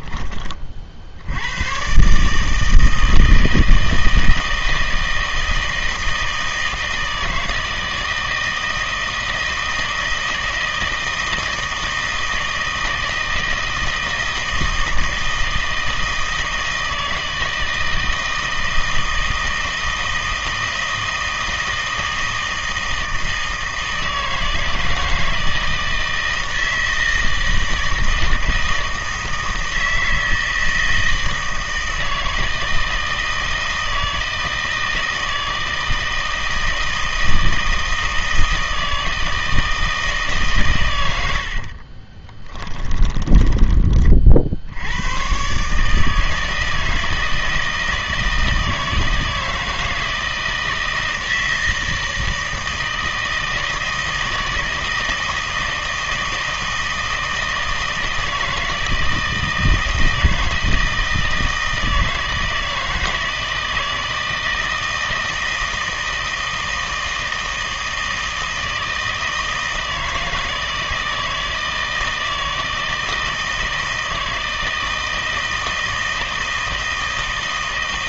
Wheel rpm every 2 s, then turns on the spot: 40, 160, 160, 160, 160, 160, 160, 160, 160, 160, 160, 160, 160, 160, 160, 160, 160, 160, 160, 160, 120, 20, 70, 160, 160, 160, 160, 160, 160, 160, 160, 160, 160, 160, 160, 160, 160, 160, 160.
42-44